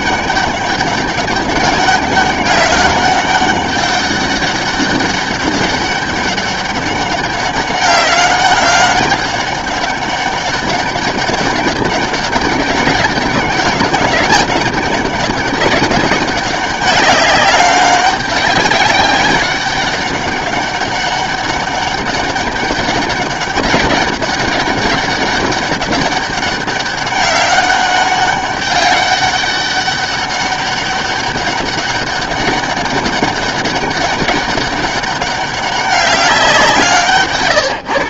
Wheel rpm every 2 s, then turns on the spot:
200, 190, 200, 200, 200, 200, 200, 200, 200, 200, 200, 200, 200, 200, 200, 190, 200, 200, 160.
none